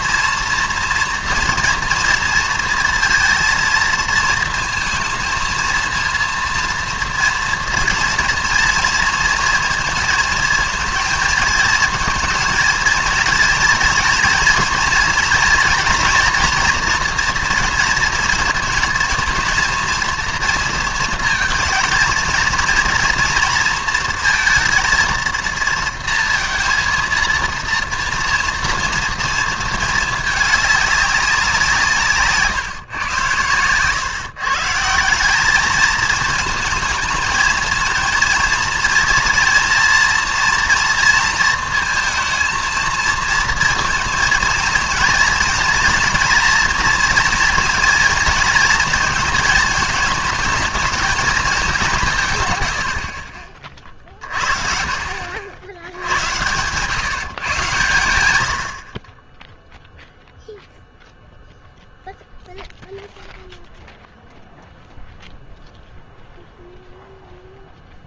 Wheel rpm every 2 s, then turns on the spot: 230, 230, 230, 230, 230, 230, 220, 240, 230, 230, 230, 220, 230, 230, 230, 220, 150, 130, 220, 230, 230, 230, 230, 230, 230, 220, 150, 50, 90, 110, 0, 0, 0, 0.
none